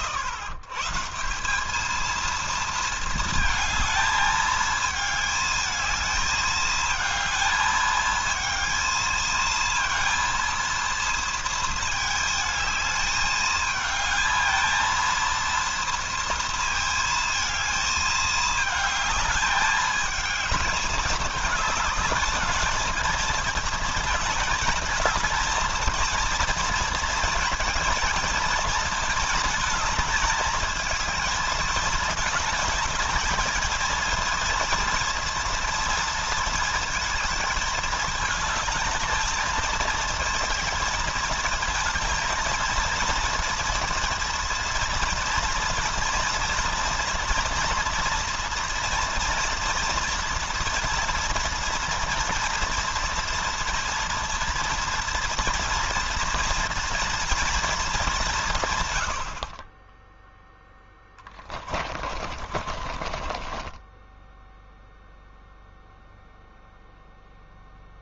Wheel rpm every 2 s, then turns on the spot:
150, 220, 220, 220, 230, 230, 220, 230, 220, 210, 210, 220, 220, 230, 220, 220, 220, 230, 220, 220, 220, 230, 230, 230, 240, 230, 230, 230, 230, 100, 10, 30, 0, 0.
60-64